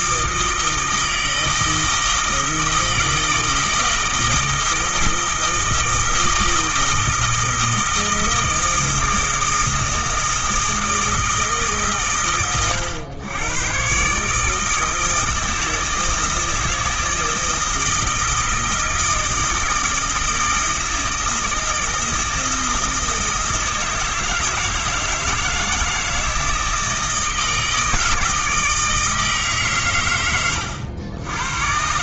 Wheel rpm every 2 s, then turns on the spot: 160, 160, 160, 160, 160, 160, 110, 160, 160, 160, 160, 160, 160, 160, 160, 80.
none